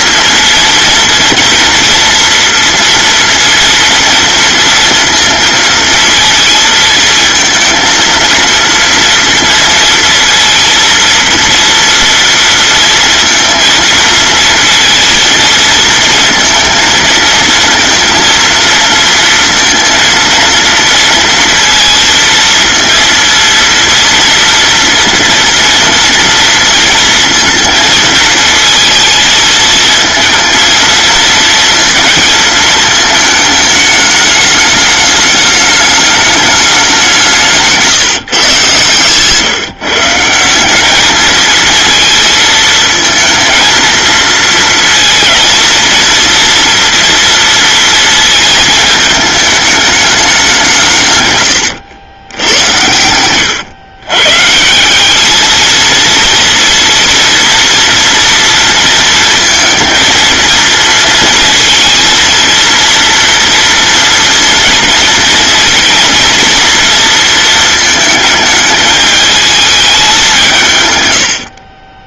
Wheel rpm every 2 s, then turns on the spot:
230, 230, 230, 220, 230, 230, 230, 230, 230, 230, 230, 230, 230, 230, 230, 230, 220, 210, 200, 140, 190, 220, 230, 230, 220, 160, 90, 170, 230, 230, 230, 230, 230, 230, 220, 140.
none